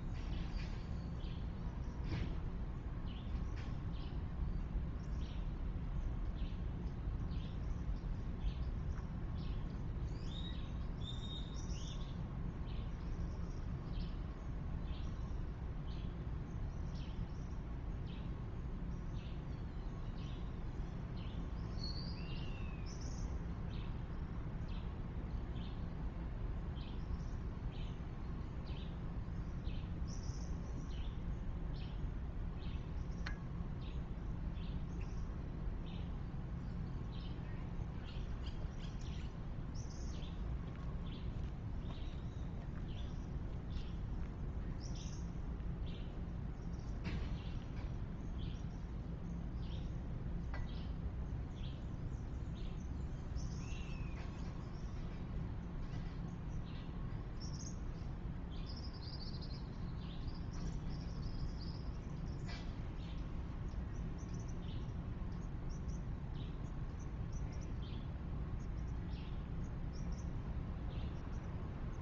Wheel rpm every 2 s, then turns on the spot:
0, 0, 0, 0, 0, 0, 0, 0, 0, 0, 0, 0, 0, 0, 0, 0, 0, 0, 0, 0, 0, 0, 0, 0, 0, 0, 0, 0, 0, 0, 0, 0, 0, 0, 0, 0.
none